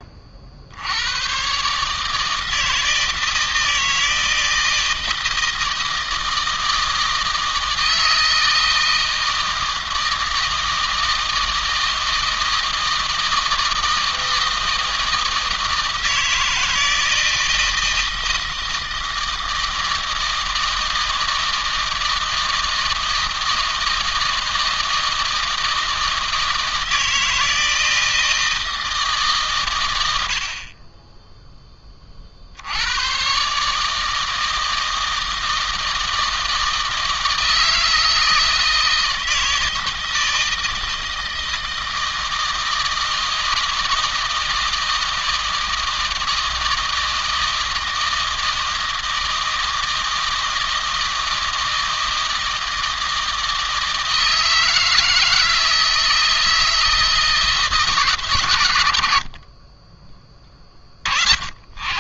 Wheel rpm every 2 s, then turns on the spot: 50, 160, 160, 160, 160, 160, 160, 160, 160, 160, 160, 160, 160, 160, 160, 50, 70, 160, 160, 160, 160, 160, 160, 160, 160, 160, 160, 160, 160, 110, 40.
none